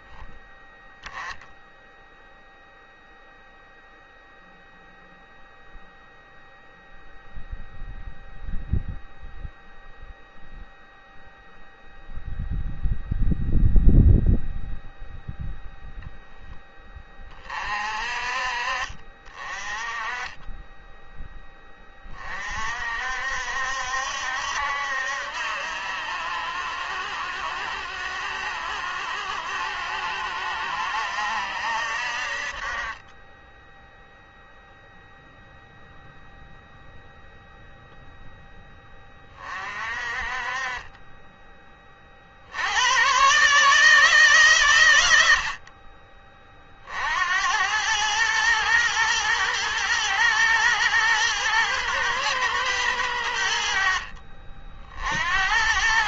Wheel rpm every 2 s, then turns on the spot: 10, 0, 0, 0, 0, 0, 0, 0, 10, 40, 10, 40, 70, 70, 70, 70, 40, 0, 0, 10, 30, 80, 120, 40, 110, 110, 110, 60.
none